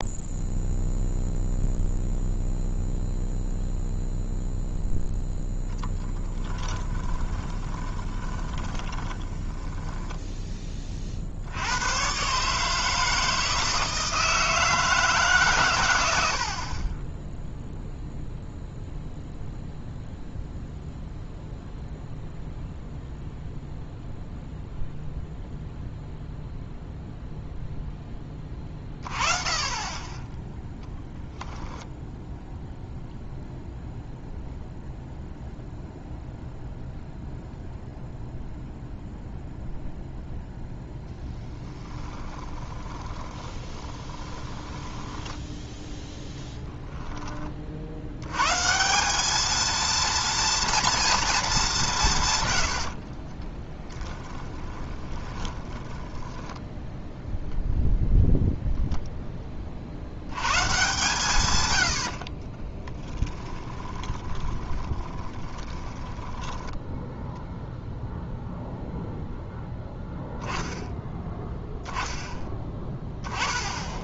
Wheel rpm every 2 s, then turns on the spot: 0, 0, 0, 20, 20, 30, 150, 160, 40, 0, 0, 0, 0, 0, 20, 10, 0, 0, 0, 0, 0, 20, 20, 10, 150, 230, 90, 20, 10, 0, 140, 30, 30, 10, 0, 10, 10.
6-10 30-32 42-48 54-58 62-68